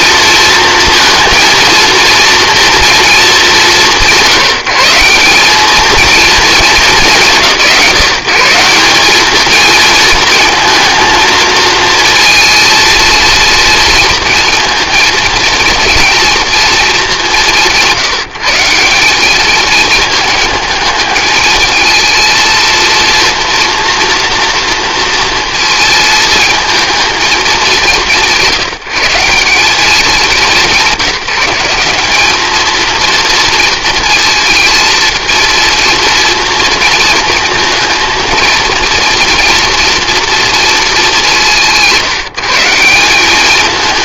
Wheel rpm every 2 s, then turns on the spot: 230, 230, 180, 210, 190, 230, 230, 230, 220, 180, 210, 230, 230, 220, 170, 190, 230, 230, 230, 230, 220, 180.
none